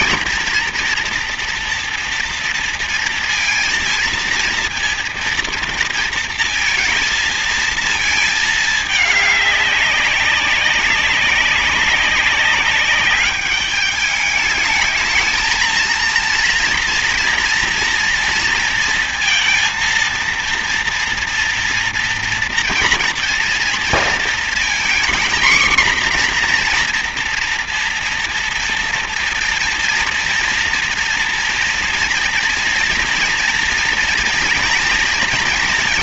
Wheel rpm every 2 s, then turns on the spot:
230, 230, 230, 230, 210, 200, 200, 210, 230, 230, 230, 240, 240, 240, 230, 230, 230, 230.
none